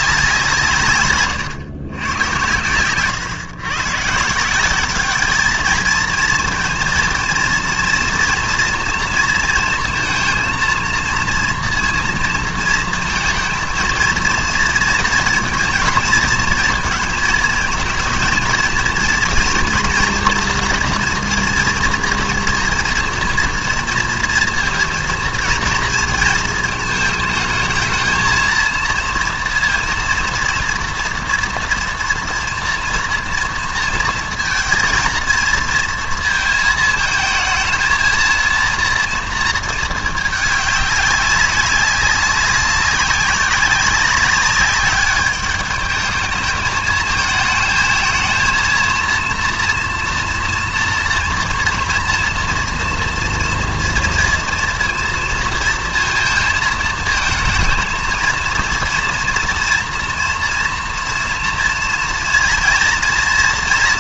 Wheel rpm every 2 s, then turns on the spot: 170, 110, 190, 230, 230, 230, 230, 230, 220, 220, 230, 230, 230, 220, 230, 230, 230, 230, 230, 230, 200, 200, 200, 220, 230, 230, 230, 230, 220, 230, 230, 230.
none